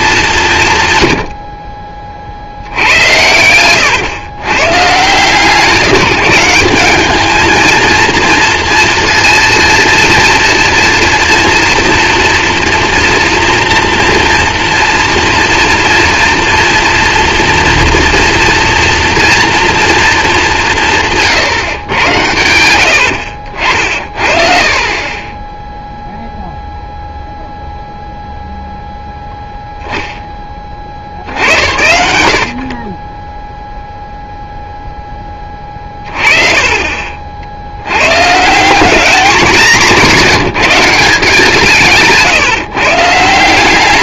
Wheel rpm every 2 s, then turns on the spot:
130, 80, 120, 190, 230, 230, 240, 230, 230, 230, 180, 90, 40, 0, 0, 40, 40, 0, 30, 180, 160, 130.
2-4 24-26 32-34 36-38